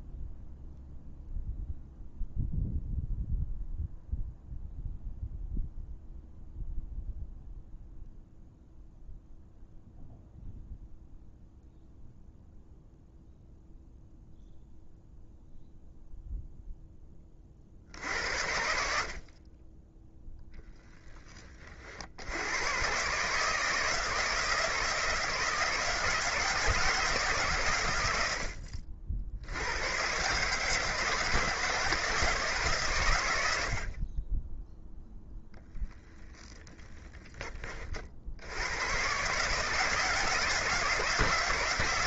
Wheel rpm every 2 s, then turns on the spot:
0, 0, 0, 0, 0, 0, 0, 0, 10, 60, 20, 120, 160, 160, 60, 150, 120, 0, 20, 110, 170.
36-38